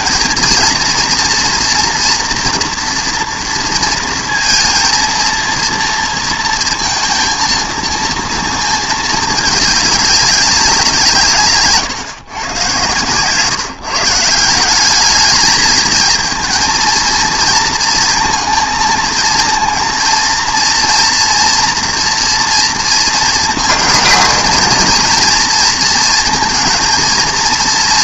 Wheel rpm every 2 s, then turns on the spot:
230, 240, 230, 230, 220, 190, 130, 190, 230, 230, 230, 230, 230, 230.
none